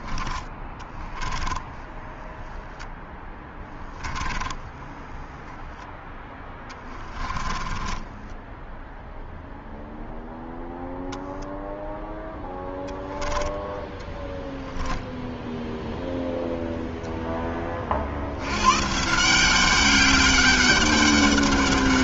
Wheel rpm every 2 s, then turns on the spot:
10, 0, 10, 20, 0, 0, 0, 0, 0, 160, 200.
0-2 4-8